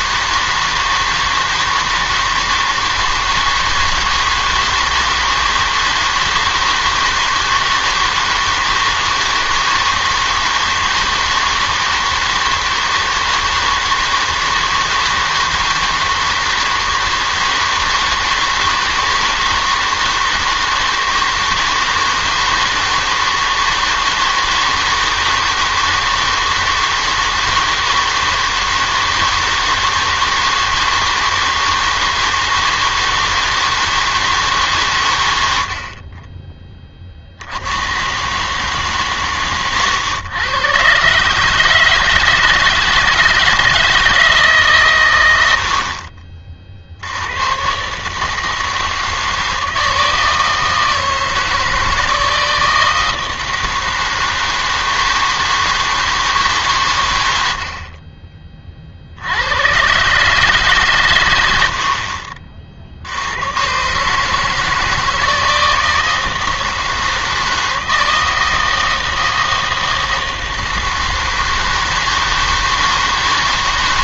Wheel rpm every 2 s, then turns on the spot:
160, 160, 160, 160, 160, 160, 160, 160, 160, 160, 160, 160, 160, 160, 160, 160, 160, 150, 20, 140, 120, 160, 150, 50, 160, 160, 160, 160, 140, 30, 140, 40, 160, 160, 160, 160, 160.
none